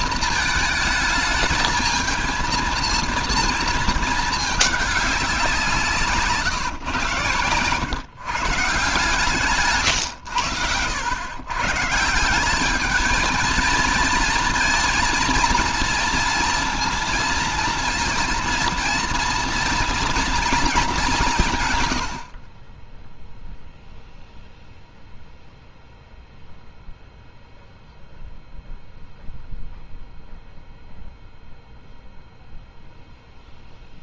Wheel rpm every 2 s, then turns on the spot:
220, 230, 200, 120, 150, 110, 220, 230, 230, 240, 200, 10, 0, 0, 0, 0, 0.
none